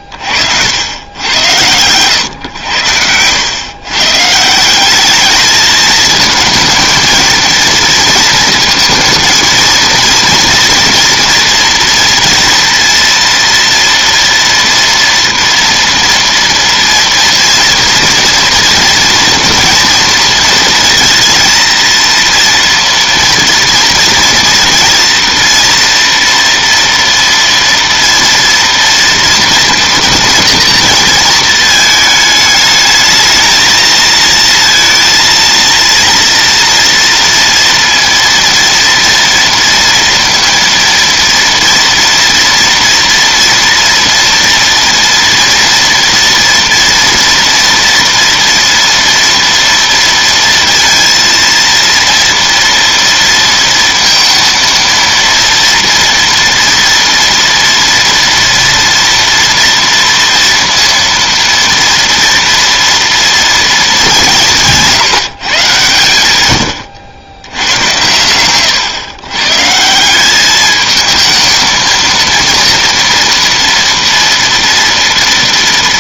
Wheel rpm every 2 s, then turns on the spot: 90, 90, 190, 230, 230, 230, 230, 230, 230, 230, 230, 230, 240, 230, 230, 230, 210, 230, 230, 230, 230, 230, 230, 230, 230, 230, 230, 230, 230, 230, 230, 230, 170, 90, 120, 210, 230, 230.
2-4